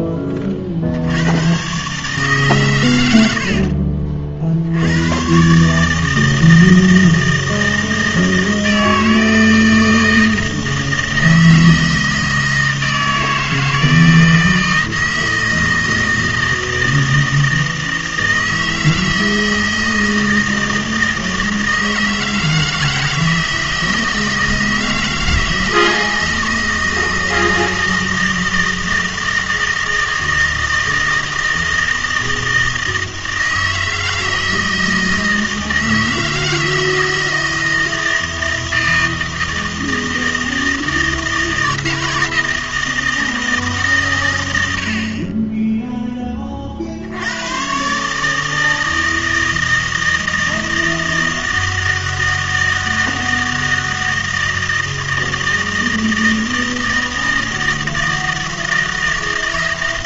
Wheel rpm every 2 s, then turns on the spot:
50, 110, 90, 160, 160, 160, 160, 160, 160, 160, 160, 160, 160, 160, 160, 160, 160, 160, 160, 160, 160, 160, 80, 40, 160, 160, 160, 160, 160, 160.
none